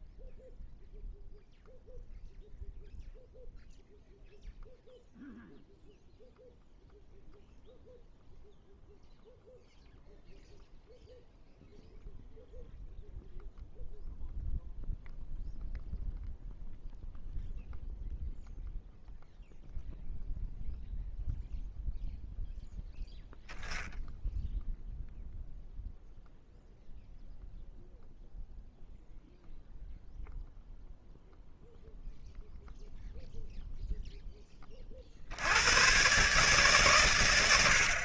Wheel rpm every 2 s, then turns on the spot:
0, 0, 0, 0, 0, 0, 0, 0, 0, 0, 0, 0, 0, 0, 0, 0, 0, 40, 140.
none